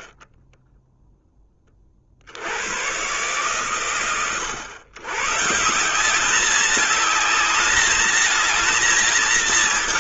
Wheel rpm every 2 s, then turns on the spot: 0, 100, 110, 210, 220.
none